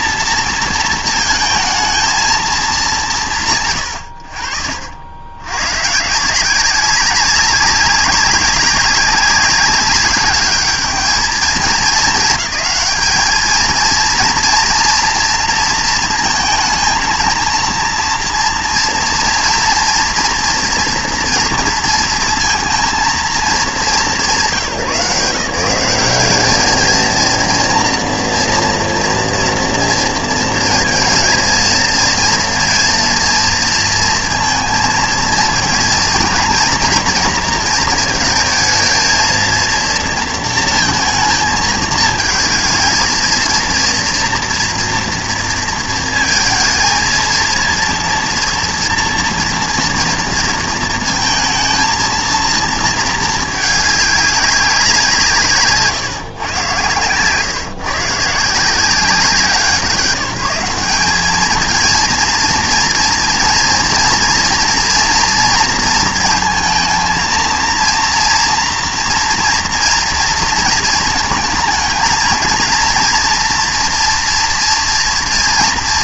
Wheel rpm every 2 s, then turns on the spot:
230, 220, 60, 180, 190, 200, 220, 240, 230, 230, 240, 230, 150, 220, 230, 230, 230, 230, 230, 220, 230, 220, 240, 230, 240, 230, 230, 200, 130, 160, 190, 230, 230, 220, 240, 230, 230, 230.
none